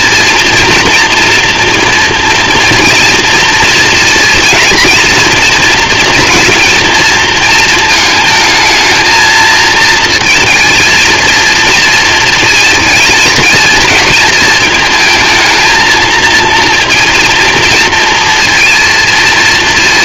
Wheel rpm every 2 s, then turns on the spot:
230, 230, 230, 230, 220, 230, 230, 230, 220, 230.
none